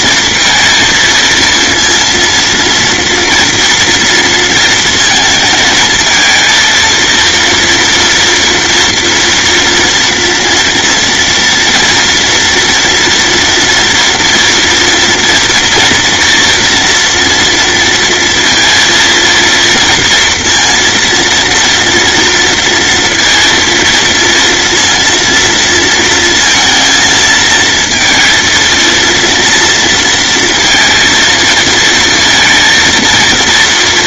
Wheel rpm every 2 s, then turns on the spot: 230, 230, 230, 230, 230, 230, 230, 230, 230, 230, 230, 230, 230, 230, 230, 230, 220.
none